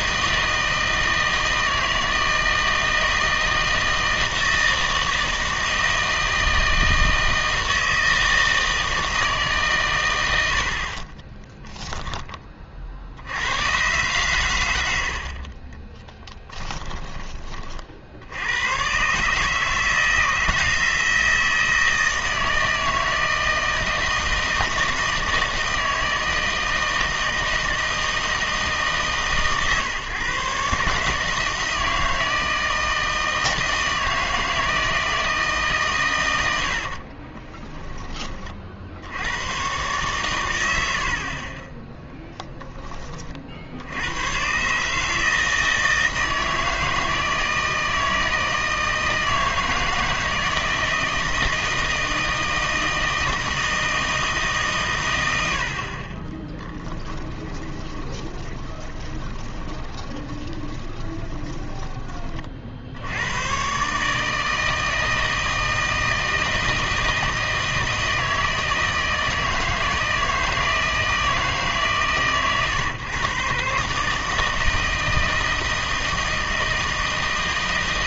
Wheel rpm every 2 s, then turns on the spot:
160, 160, 160, 160, 160, 60, 50, 80, 20, 110, 170, 160, 160, 160, 150, 140, 160, 160, 60, 60, 90, 20, 140, 160, 160, 160, 160, 140, 10, 20, 20, 50, 160, 160, 160, 160, 130, 160, 160.
14-18 36-38 42-44 56-62